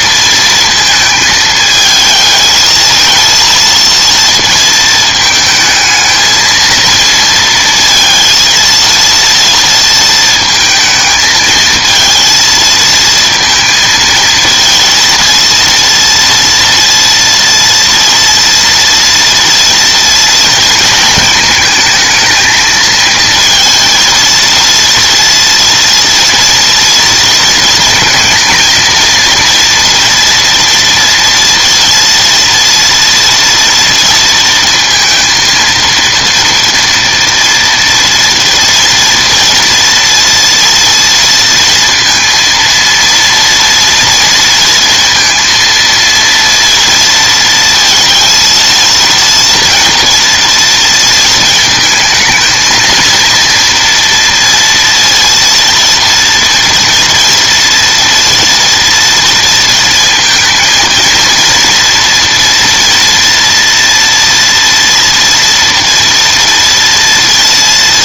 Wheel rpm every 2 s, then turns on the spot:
230, 220, 220, 230, 230, 220, 230, 220, 230, 230, 230, 220, 230, 230, 230, 230, 230, 230, 230, 230, 230, 230, 230, 230, 220, 230, 220, 230, 230, 240, 230, 230, 230, 230.
none